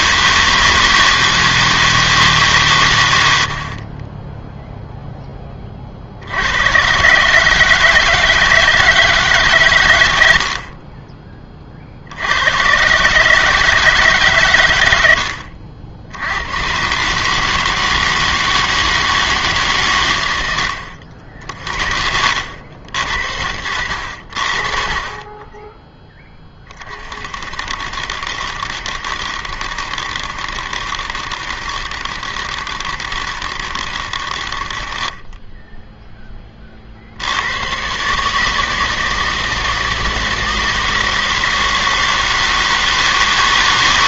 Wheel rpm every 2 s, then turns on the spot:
160, 140, 0, 100, 160, 50, 110, 110, 110, 160, 90, 70, 50, 20, 60, 70, 70, 50, 40, 160, 160, 160.
none